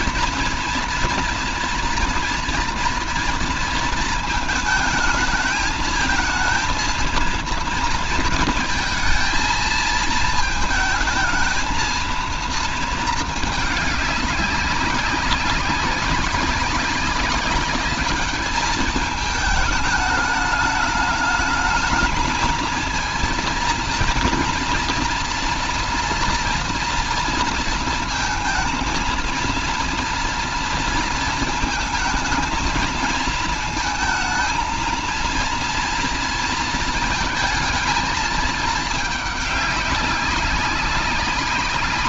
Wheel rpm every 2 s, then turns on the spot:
230, 230, 230, 230, 230, 220, 220, 200, 190, 210, 210, 220, 230, 230, 230, 240, 220, 230, 230, 220, 200.
none